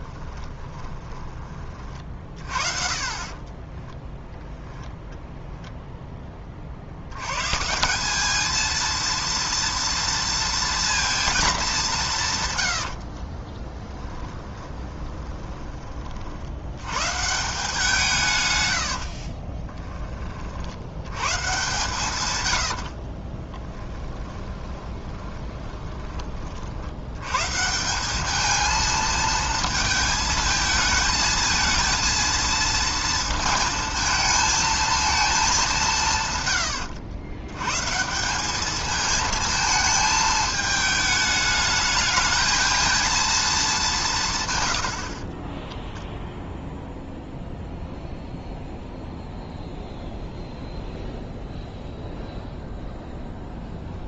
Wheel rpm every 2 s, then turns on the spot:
20, 40, 10, 70, 230, 230, 70, 30, 110, 80, 80, 70, 20, 70, 220, 220, 230, 230, 90, 210, 210, 220, 90, 0, 0, 0, 0.
0-2 12-16 18-20 22-26